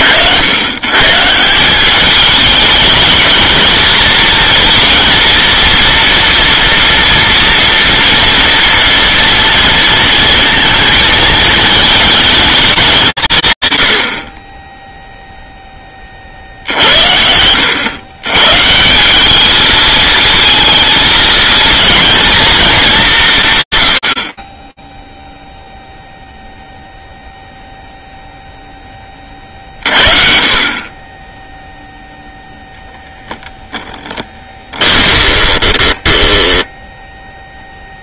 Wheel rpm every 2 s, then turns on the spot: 100, 210, 230, 230, 230, 230, 190, 10, 70, 150, 220, 200, 10, 0, 20, 20, 0, 30, 0.
34-36